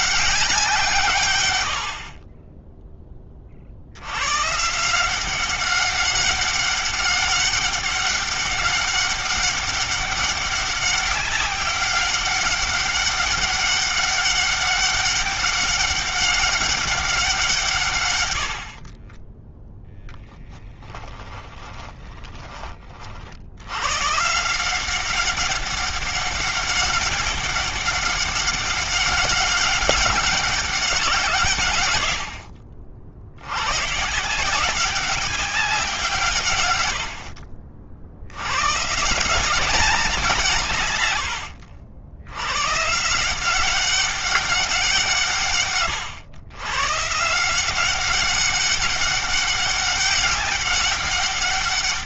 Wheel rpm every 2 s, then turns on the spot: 160, 20, 170, 200, 200, 200, 200, 200, 190, 40, 10, 40, 190, 200, 200, 180, 60, 190, 100, 150, 130, 150, 170, 140, 200, 200.
18-22